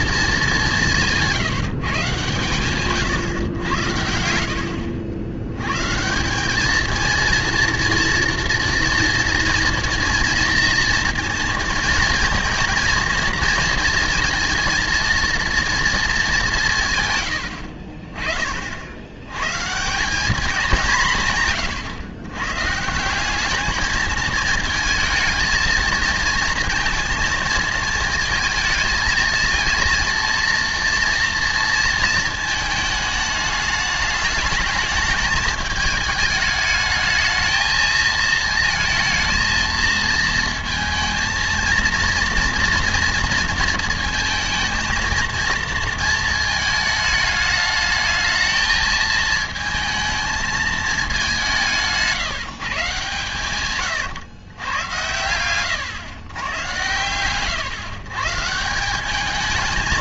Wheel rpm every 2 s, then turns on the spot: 170, 130, 80, 230, 230, 230, 230, 230, 110, 90, 160, 180, 220, 230, 230, 230, 210, 220, 220, 230, 230, 230, 220, 220, 220, 190, 130, 110, 120, 200.
16-18